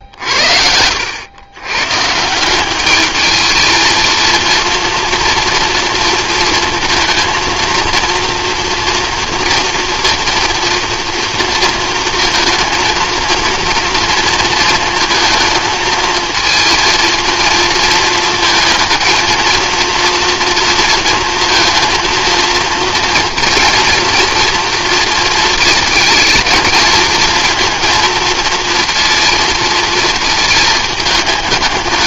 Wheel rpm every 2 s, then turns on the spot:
80, 190, 230, 230, 230, 230, 220, 230, 230, 220, 230, 230, 230, 220, 230, 220.
none